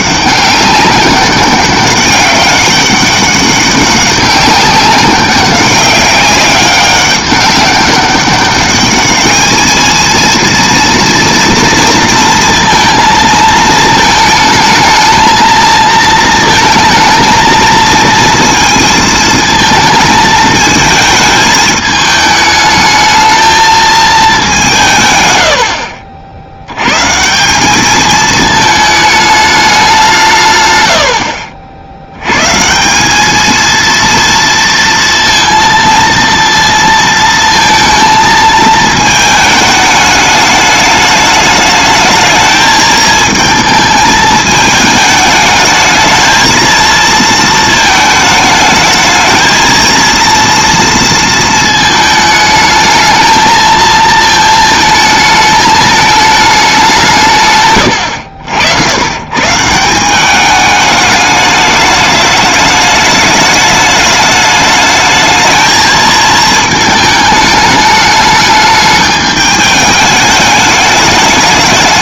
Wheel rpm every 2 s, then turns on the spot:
200, 200, 200, 200, 210, 230, 230, 220, 230, 220, 220, 220, 170, 110, 220, 90, 170, 230, 230, 220, 210, 220, 220, 230, 220, 230, 220, 220, 180, 80, 210, 210, 210, 220, 210, 210.
none